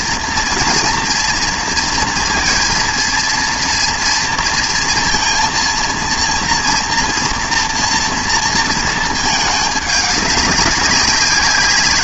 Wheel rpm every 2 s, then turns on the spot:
230, 230, 230, 230, 220, 190.
none